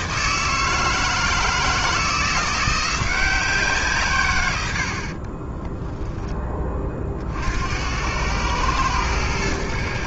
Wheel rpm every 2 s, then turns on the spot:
160, 170, 90, 20, 110.
none